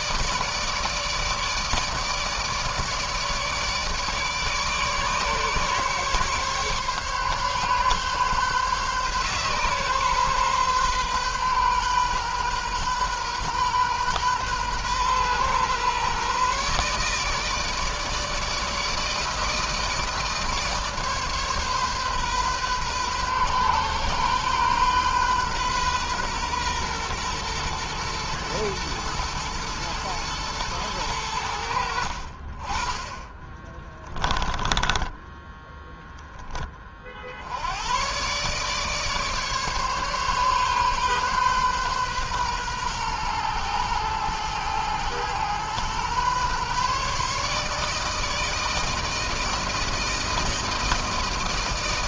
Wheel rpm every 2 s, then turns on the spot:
150, 150, 150, 140, 140, 140, 130, 120, 140, 160, 160, 130, 130, 120, 120, 110, 60, 10, 10, 120, 140, 130, 110, 130, 160, 160.
34-36